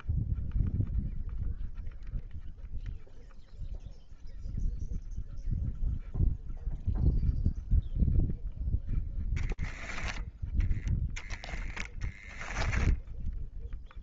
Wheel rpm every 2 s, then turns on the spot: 0, 0, 0, 0, 0, 10, 10.
none